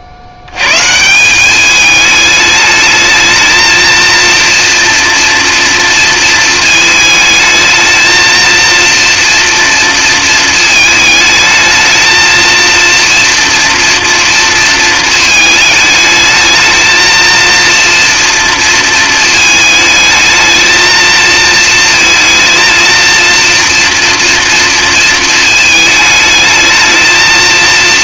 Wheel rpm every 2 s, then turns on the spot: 150, 220, 230, 220, 230, 220, 230, 230, 220, 230, 220, 230, 230, 220.
none